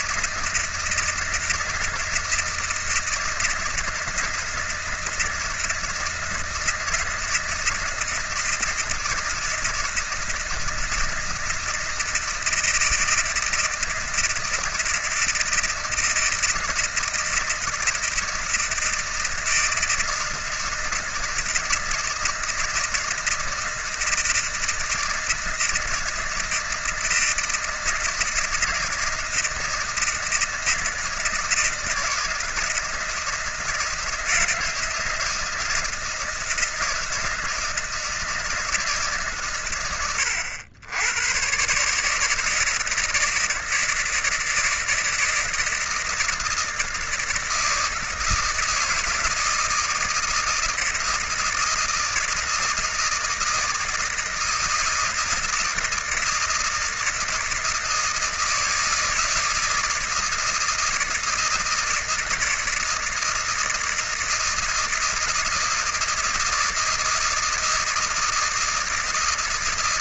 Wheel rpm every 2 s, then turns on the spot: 160, 160, 160, 160, 160, 160, 160, 160, 160, 160, 160, 160, 160, 160, 160, 160, 160, 160, 160, 160, 90, 160, 160, 160, 170, 160, 160, 160, 160, 160, 170, 160, 160, 160, 160.
none